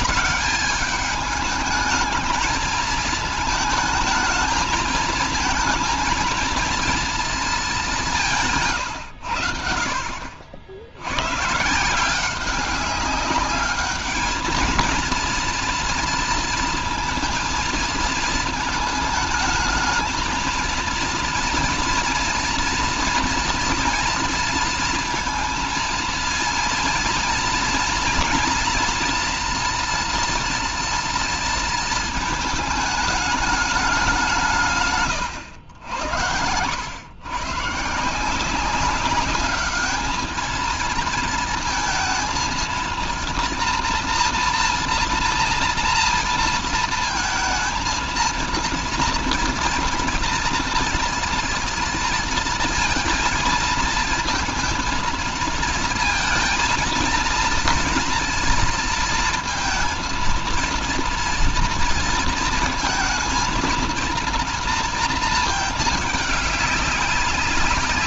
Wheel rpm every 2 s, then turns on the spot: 200, 220, 220, 230, 130, 70, 190, 220, 230, 220, 230, 230, 230, 230, 240, 230, 220, 160, 90, 190, 220, 220, 230, 230, 230, 230, 230, 220, 230, 230, 230, 230, 230, 200.
none